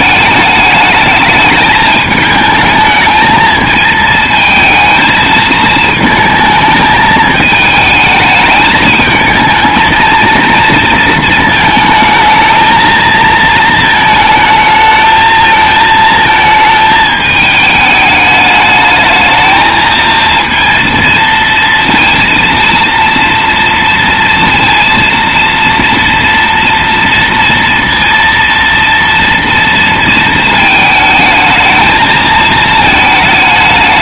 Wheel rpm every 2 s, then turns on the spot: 210, 220, 220, 220, 220, 230, 220, 220, 220, 210, 230, 230, 230, 230, 230, 220, 220.
none